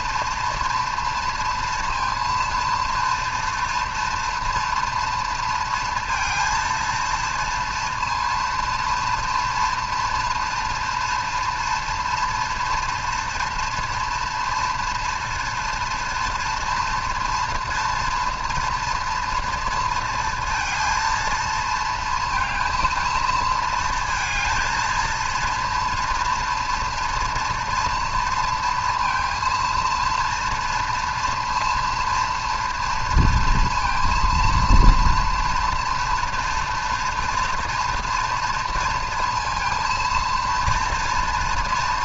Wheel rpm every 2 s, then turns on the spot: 230, 230, 230, 230, 230, 230, 240, 230, 230, 230, 230, 230, 230, 230, 230, 230, 240, 230, 230, 230, 230.
none